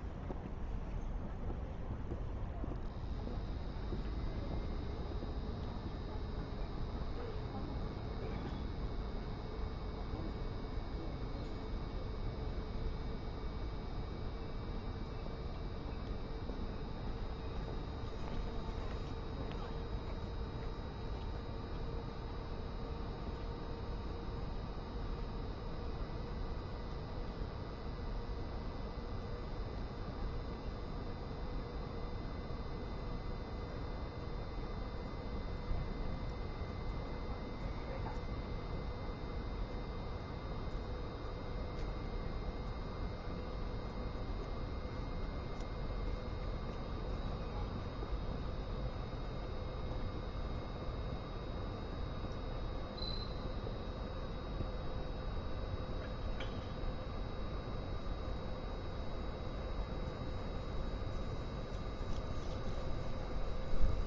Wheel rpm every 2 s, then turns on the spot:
0, 0, 0, 0, 0, 0, 0, 0, 0, 0, 0, 0, 0, 0, 0, 0, 0, 0, 0, 0, 0, 0, 0, 0, 0, 0, 0, 0, 0, 0, 0, 0.
none